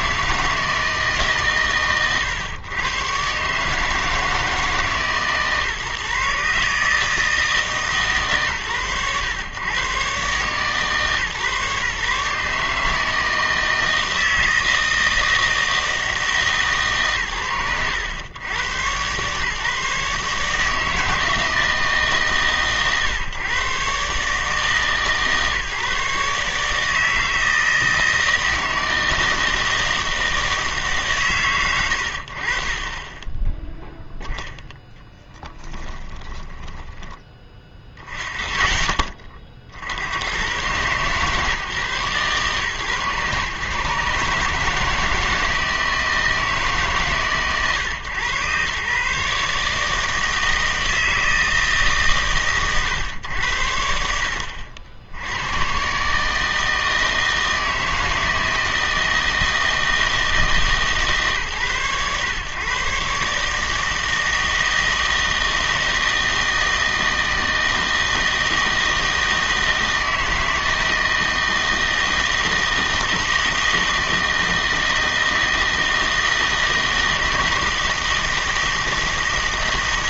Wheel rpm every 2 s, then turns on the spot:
160, 110, 160, 150, 110, 130, 150, 160, 130, 100, 150, 130, 150, 150, 160, 160, 40, 10, 10, 30, 120, 130, 150, 140, 130, 160, 110, 60, 160, 160, 160, 130, 160, 160, 160, 160, 160, 160, 160, 160.
36-38